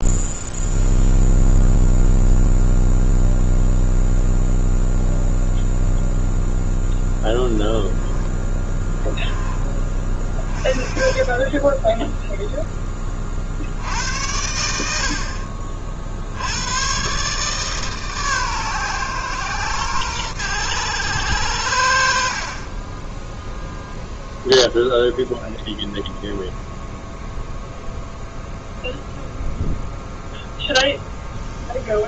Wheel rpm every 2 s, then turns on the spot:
0, 0, 0, 0, 10, 20, 10, 70, 100, 130, 100, 30, 0, 0, 0, 0.
none